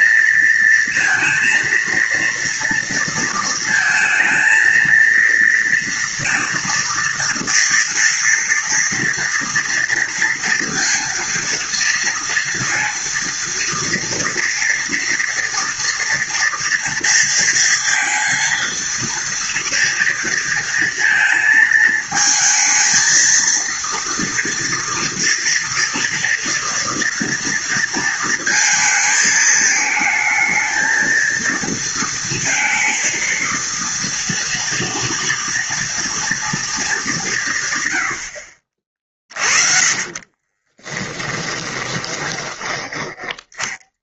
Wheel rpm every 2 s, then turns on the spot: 230, 230, 230, 230, 230, 230, 230, 230, 230, 230, 230, 220, 230, 230, 230, 220, 230, 230, 220, 60, 30, 10.
40-44